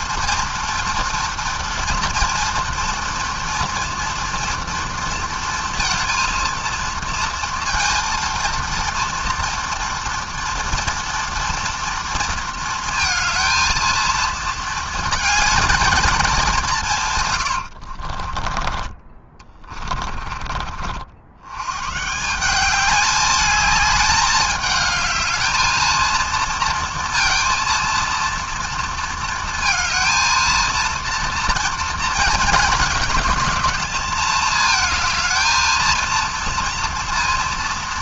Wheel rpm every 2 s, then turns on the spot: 230, 240, 230, 230, 230, 230, 230, 220, 120, 20, 70, 210, 220, 230, 230, 230, 210, 220, 230.
16-20